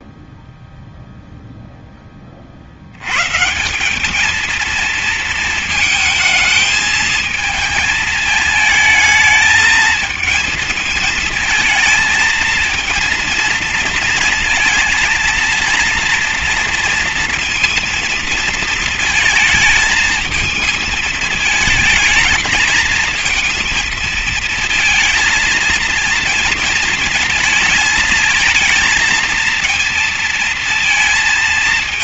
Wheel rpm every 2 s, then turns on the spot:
0, 40, 220, 220, 220, 220, 230, 230, 230, 230, 220, 220, 220, 230, 230, 230.
none